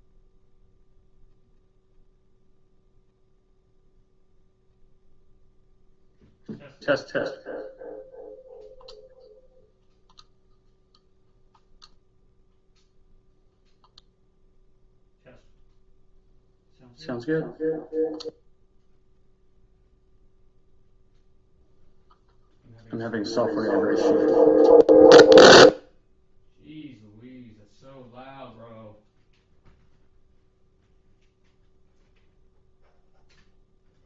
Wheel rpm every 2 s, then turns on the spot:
0, 0, 0, 0, 0, 0, 0, 0, 0, 0, 0, 0, 0, 0, 0, 0, 0.
none